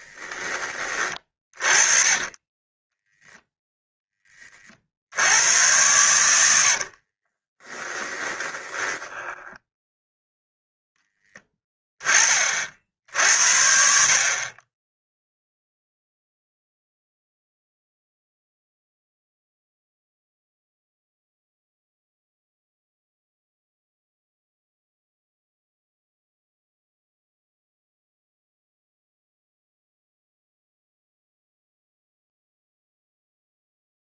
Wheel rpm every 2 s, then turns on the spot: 20, 10, 70, 40, 10, 0, 50, 10, 0, 0, 0, 0, 0, 0, 0, 0, 0.
2-4 6-10